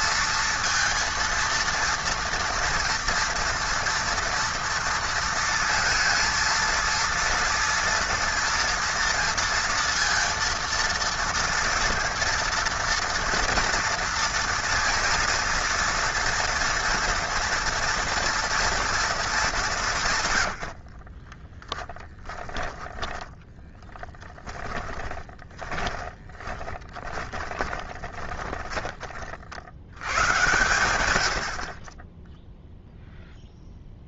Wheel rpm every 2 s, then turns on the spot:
230, 230, 230, 230, 230, 230, 230, 230, 230, 230, 70, 10, 10, 20, 20, 120, 0.
20-28